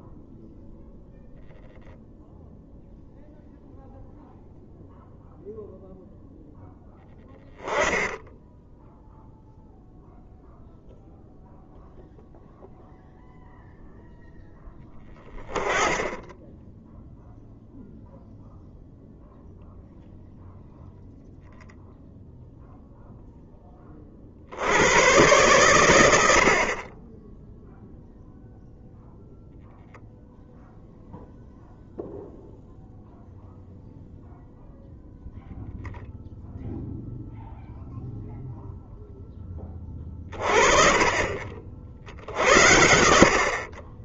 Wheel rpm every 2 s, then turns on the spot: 0, 0, 0, 10, 0, 0, 0, 10, 10, 0, 0, 0, 90, 40, 0, 0, 0, 0, 0, 0, 30, 70.
none